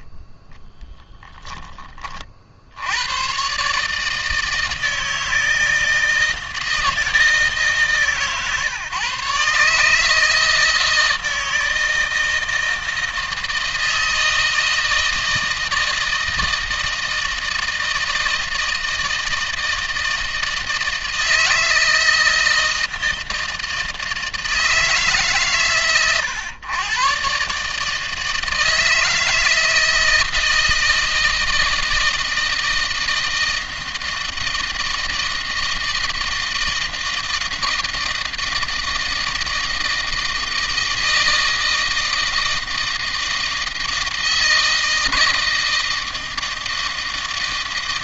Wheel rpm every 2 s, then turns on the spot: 20, 50, 160, 160, 150, 160, 160, 160, 160, 160, 160, 160, 160, 130, 160, 160, 160, 160, 160, 160, 160, 160, 160, 160.
none